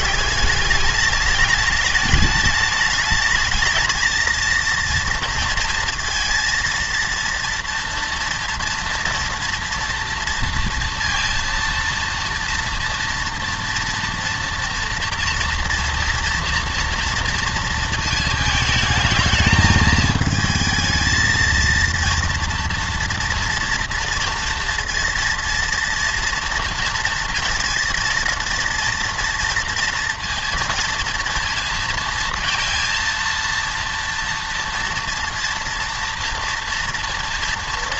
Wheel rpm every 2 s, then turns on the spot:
200, 220, 230, 230, 230, 230, 230, 230, 230, 220, 220, 230, 230, 230, 230, 230, 230, 240, 230.
none